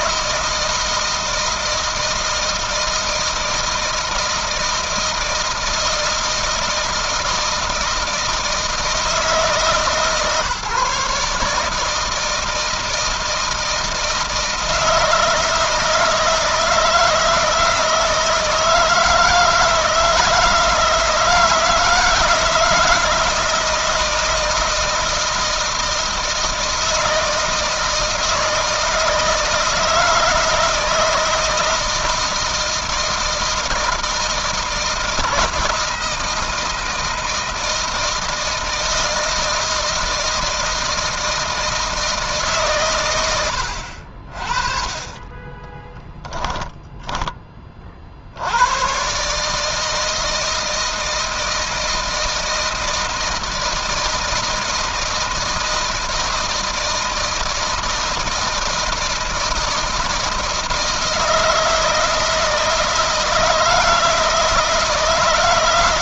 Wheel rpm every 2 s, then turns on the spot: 160, 160, 160, 160, 160, 140, 160, 160, 160, 160, 160, 160, 160, 160, 160, 160, 160, 170, 160, 160, 160, 130, 40, 10, 100, 160, 160, 160, 160, 160, 160, 160, 160.
46-48